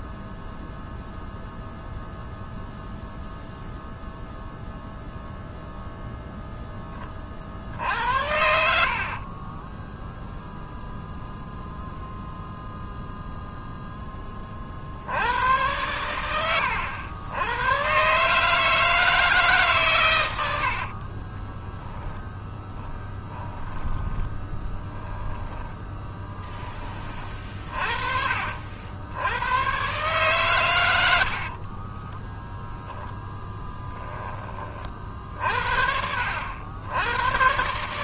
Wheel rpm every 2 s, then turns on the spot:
0, 0, 0, 10, 60, 0, 0, 40, 100, 160, 70, 10, 10, 20, 70, 110, 0, 40, 80.
20-26